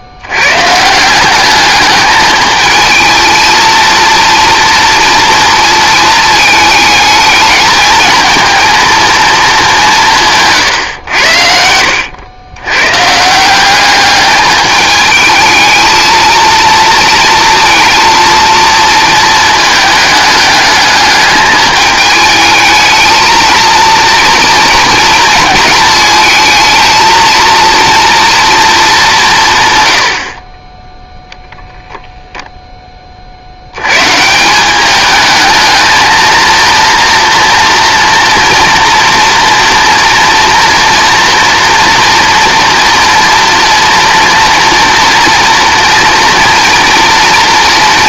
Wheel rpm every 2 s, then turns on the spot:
140, 220, 230, 220, 230, 130, 110, 210, 230, 230, 210, 220, 230, 220, 220, 20, 10, 190, 230, 230, 230, 230, 230, 230.
none